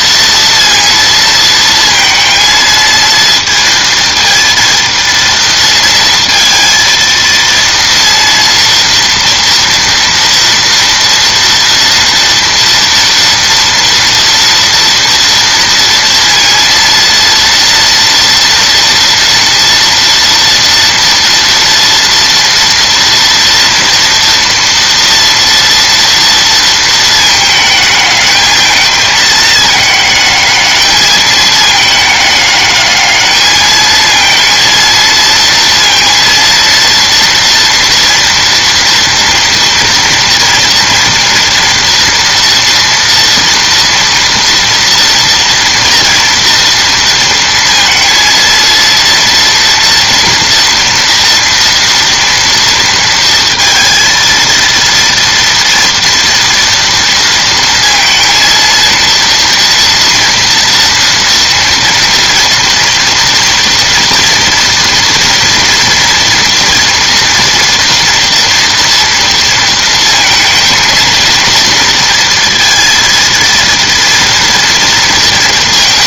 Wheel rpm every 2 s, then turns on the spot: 230, 230, 230, 230, 230, 230, 230, 230, 230, 240, 230, 230, 230, 220, 220, 210, 210, 230, 230, 240, 230, 230, 230, 230, 230, 230, 230, 230, 230, 230, 230, 230, 230, 230, 240, 230, 230, 230.
none